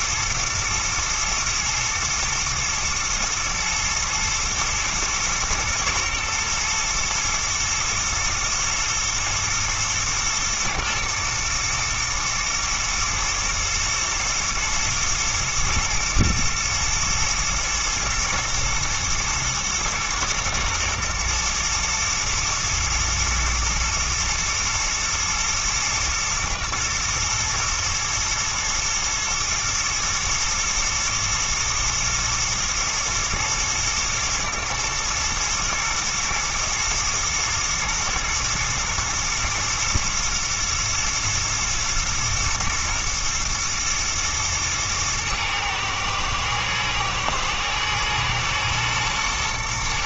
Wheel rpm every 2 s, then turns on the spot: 110, 120, 110, 120, 120, 120, 110, 110, 110, 120, 120, 110, 120, 110, 120, 110, 110, 110, 110, 110, 110, 110, 110, 110, 110.
none